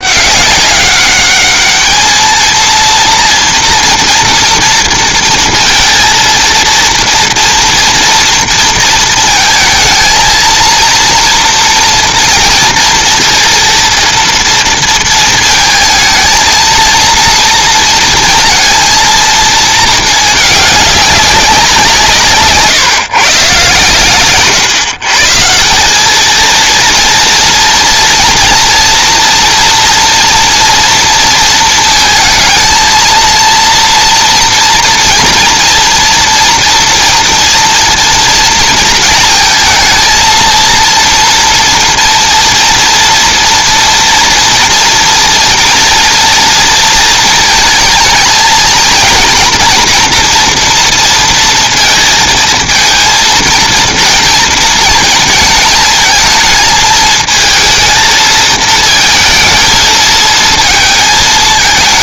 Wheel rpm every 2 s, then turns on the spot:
200, 230, 230, 230, 230, 230, 230, 230, 230, 230, 210, 140, 130, 230, 230, 230, 220, 230, 230, 230, 230, 230, 230, 230, 240, 230, 230, 230, 220, 230, 220.
none